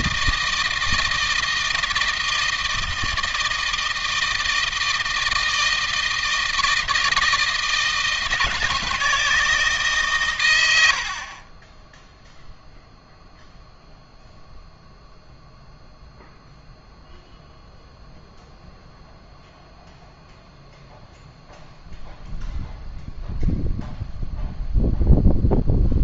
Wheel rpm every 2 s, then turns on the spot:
160, 160, 160, 160, 160, 80, 0, 0, 0, 0, 0, 0, 0.
none